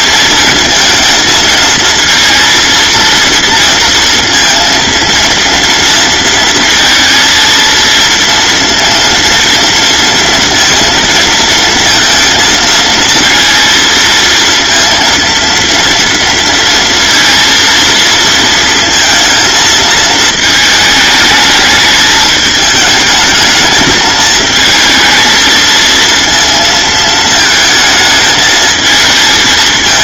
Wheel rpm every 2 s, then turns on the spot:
230, 230, 230, 230, 230, 230, 230, 230, 230, 230, 220, 220, 220, 230, 210.
none